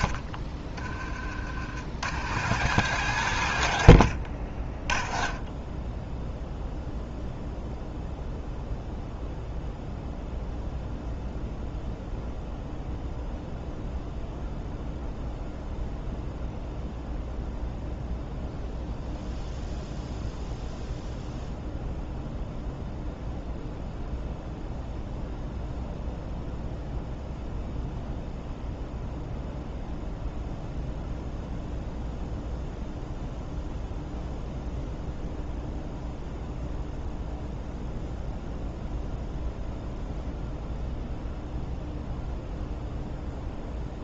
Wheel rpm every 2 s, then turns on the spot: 30, 110, 30, 0, 0, 0, 0, 0, 0, 0, 0, 0, 0, 0, 0, 0, 0, 0, 0, 0, 0, 0.
none